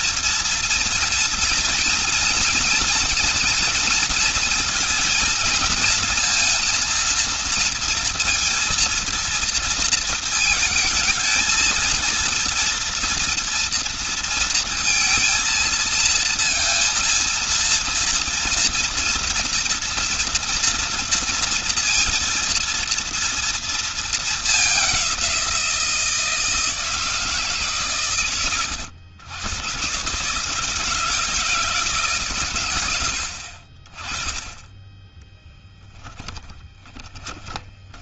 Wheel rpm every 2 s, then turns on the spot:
230, 230, 230, 230, 230, 230, 230, 230, 230, 230, 230, 230, 210, 160, 110, 140, 130, 20, 10.
36-38